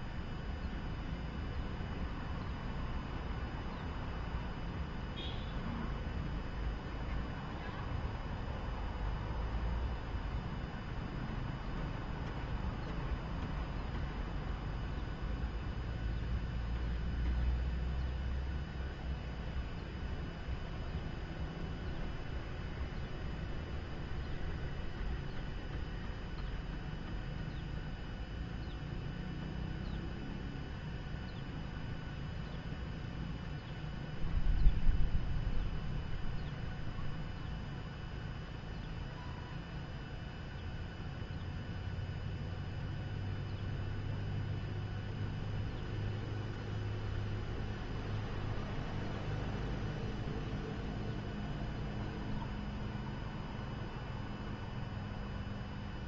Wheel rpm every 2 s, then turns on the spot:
0, 0, 0, 0, 0, 0, 0, 0, 0, 0, 0, 0, 0, 0, 0, 0, 0, 0, 0, 0, 0, 0, 0, 0, 0, 0, 0, 0.
none